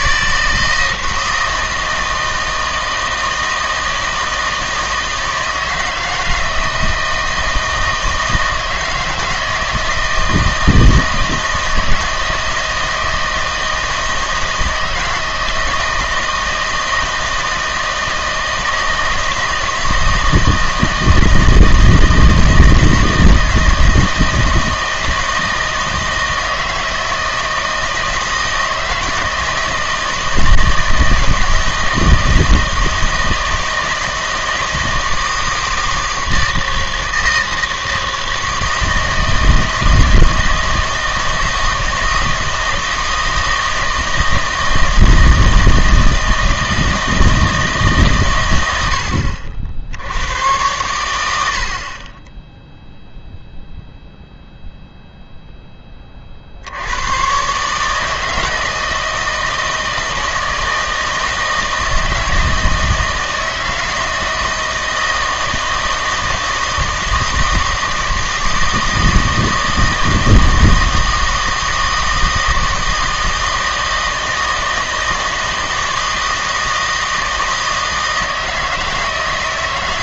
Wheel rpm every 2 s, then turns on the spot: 160, 160, 160, 160, 160, 160, 160, 160, 160, 160, 160, 160, 160, 160, 160, 160, 160, 160, 160, 160, 160, 160, 160, 160, 90, 110, 0, 0, 70, 160, 160, 160, 160, 160, 160, 160, 160, 160, 160, 160.
none